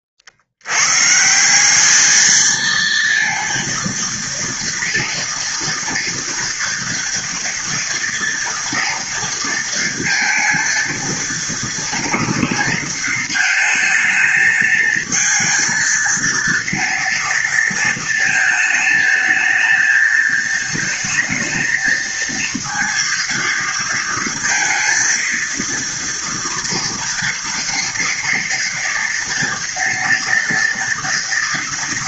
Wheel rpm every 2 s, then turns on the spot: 120, 230, 230, 230, 230, 230, 230, 230, 230, 220, 220, 230, 230, 230, 230, 230.
none